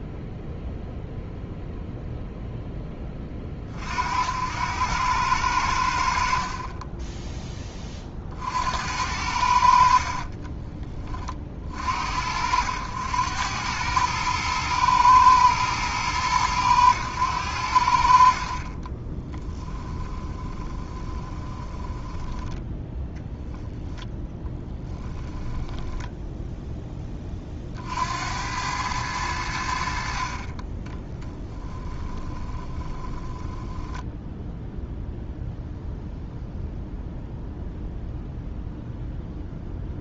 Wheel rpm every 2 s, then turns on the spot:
0, 10, 90, 20, 70, 20, 90, 110, 100, 40, 20, 10, 10, 10, 100, 20, 20, 0, 0, 0.
10-12 18-22 24-26 30-34